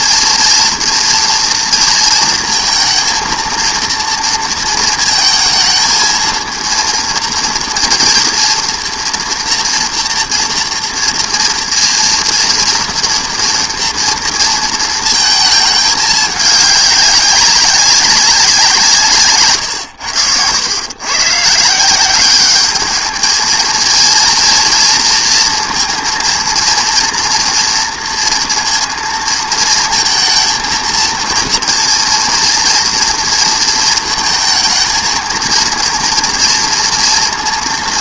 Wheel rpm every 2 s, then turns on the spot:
230, 230, 230, 230, 240, 230, 230, 230, 200, 170, 90, 200, 230, 230, 230, 230, 230, 220, 230.
none